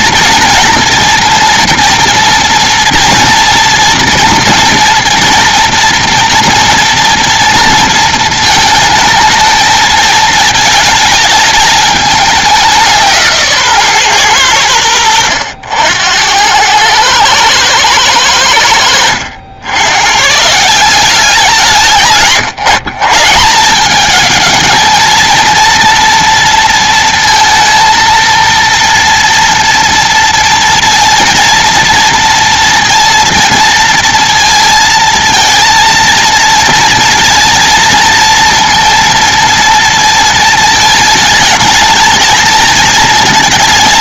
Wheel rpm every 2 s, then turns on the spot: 230, 240, 240, 230, 220, 220, 190, 100, 100, 100, 170, 160, 220, 230, 230, 230, 230, 230, 230, 230, 220, 230.
none